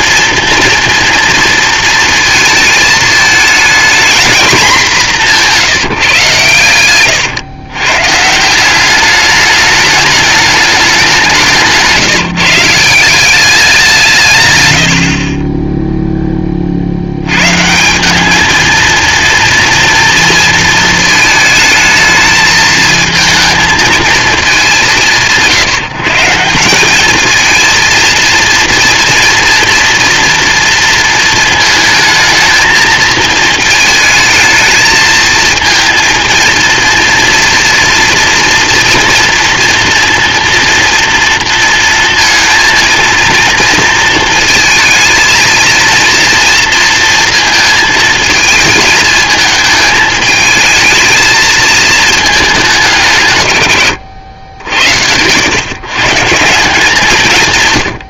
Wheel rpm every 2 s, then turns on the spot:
240, 230, 230, 120, 180, 210, 160, 120, 40, 220, 220, 220, 170, 170, 230, 230, 220, 220, 230, 230, 230, 230, 220, 230, 220, 220, 200, 80, 160.
none